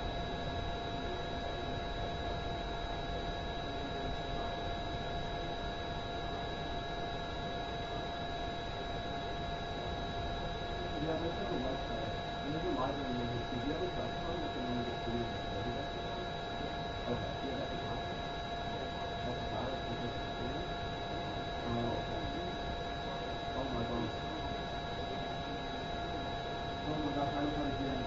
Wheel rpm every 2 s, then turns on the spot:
0, 0, 0, 0, 0, 0, 0, 0, 0, 0, 0, 0, 0, 0.
none